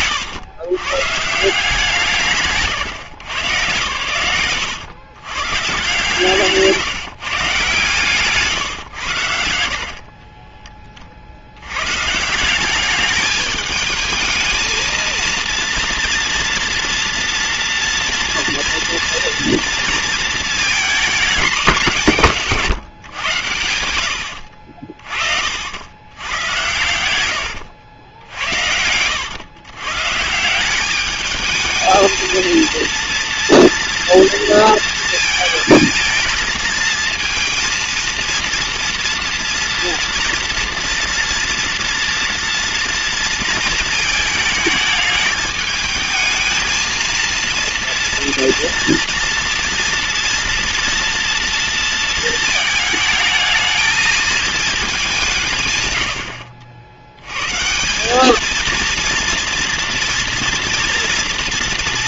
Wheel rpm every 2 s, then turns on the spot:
130, 140, 120, 150, 120, 30, 200, 230, 230, 230, 220, 140, 40, 110, 90, 200, 230, 230, 230, 230, 230, 230, 220, 230, 240, 230, 220, 210, 90, 230, 230.
22-24 26-28